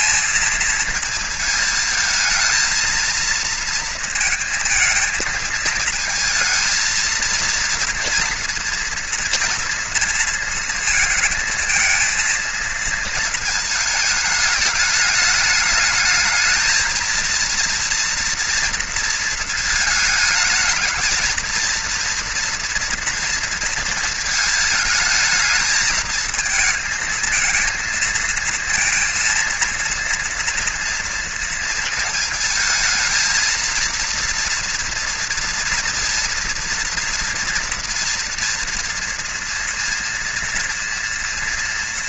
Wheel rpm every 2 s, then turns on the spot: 230, 220, 220, 230, 230, 230, 230, 220, 220, 230, 220, 230, 220, 220, 230, 230, 230, 230, 230, 230, 230.
none